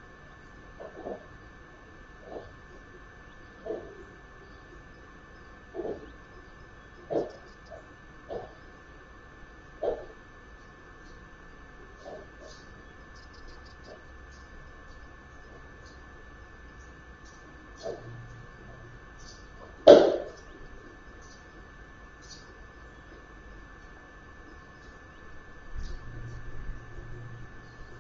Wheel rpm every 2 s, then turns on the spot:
0, 0, 0, 0, 0, 0, 0, 0, 0, 0, 0, 0, 0, 0.
none